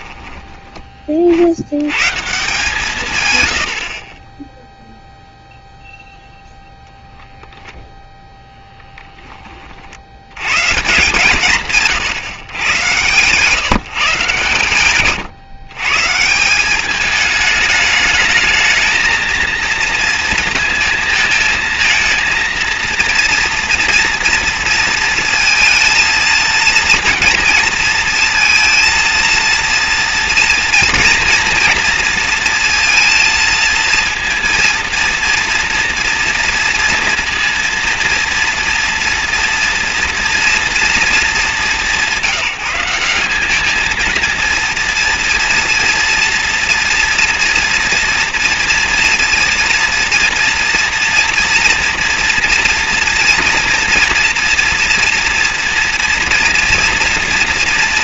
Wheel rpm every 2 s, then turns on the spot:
20, 150, 0, 0, 20, 130, 120, 130, 200, 220, 230, 230, 230, 230, 230, 230, 230, 230, 230, 230, 230, 180, 230, 240, 230, 230, 230, 230, 230.
14-16